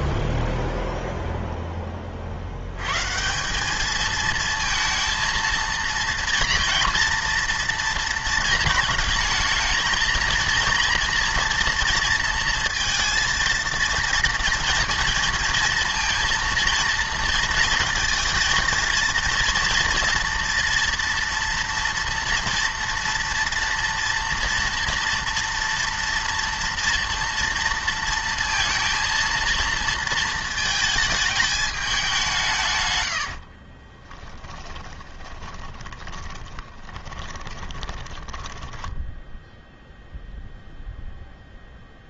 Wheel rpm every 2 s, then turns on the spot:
0, 100, 230, 230, 220, 230, 230, 230, 230, 230, 240, 230, 230, 230, 230, 220, 140, 20, 20, 10, 0.
34-40